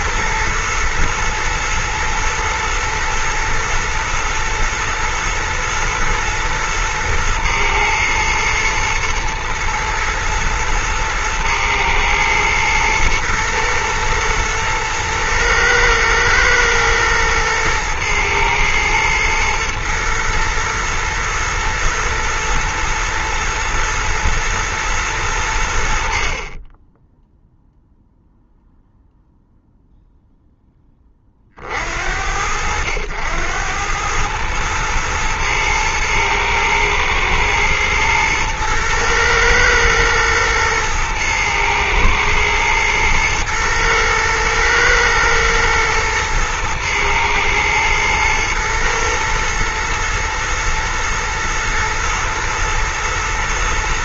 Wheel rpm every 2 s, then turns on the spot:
110, 120, 120, 110, 110, 110, 110, 110, 110, 110, 110, 120, 100, 10, 0, 10, 80, 110, 120, 110, 110, 110, 110, 120, 120, 110, 110.
none